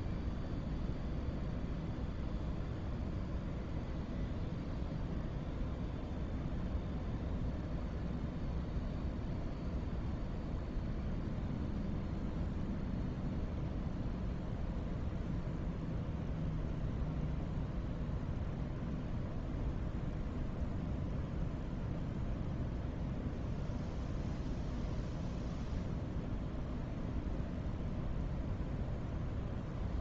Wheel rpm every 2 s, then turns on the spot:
0, 0, 0, 0, 0, 0, 0, 0, 0, 0, 0, 0, 0, 0, 0.
none